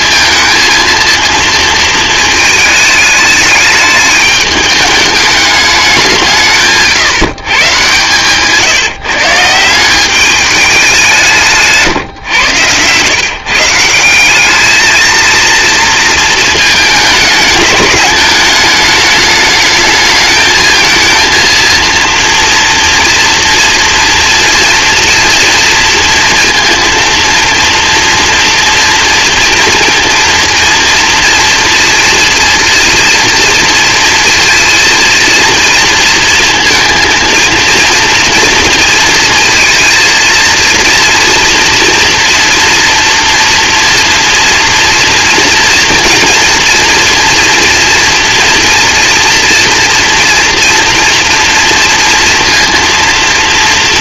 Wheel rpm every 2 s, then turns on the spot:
230, 210, 210, 160, 150, 200, 120, 220, 220, 210, 220, 230, 240, 230, 230, 230, 230, 230, 230, 230, 230, 230, 230, 230, 230, 230, 230.
none